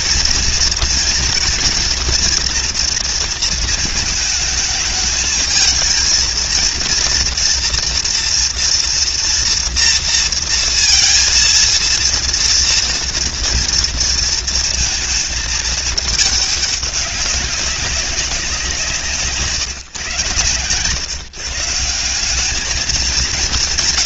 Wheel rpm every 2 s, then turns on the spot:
230, 230, 220, 230, 240, 230, 230, 220, 190, 160, 140, 220.
none